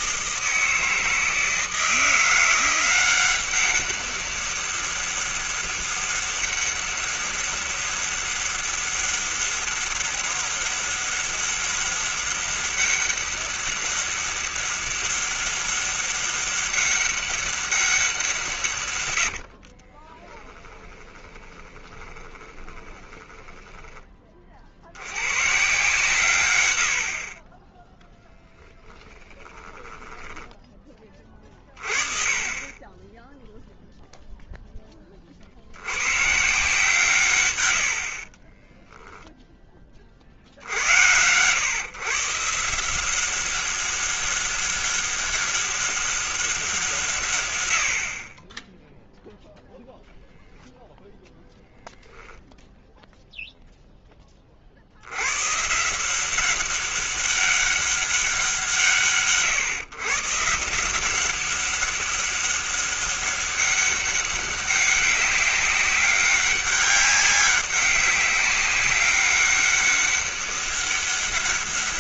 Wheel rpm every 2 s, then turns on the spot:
160, 180, 200, 200, 200, 200, 200, 200, 200, 130, 20, 20, 50, 110, 10, 10, 20, 10, 140, 30, 60, 160, 200, 180, 20, 0, 0, 30, 190, 170, 160, 200, 200, 200, 200, 200.
20-24 28-30 38-40